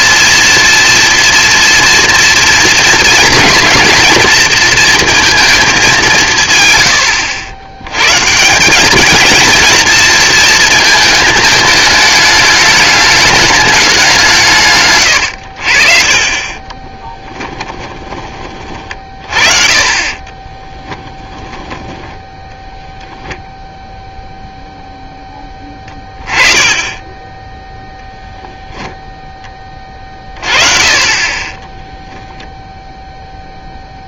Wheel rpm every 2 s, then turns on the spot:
230, 230, 230, 120, 190, 230, 210, 140, 30, 30, 20, 0, 0, 20, 0, 40, 0.
16-18 20-22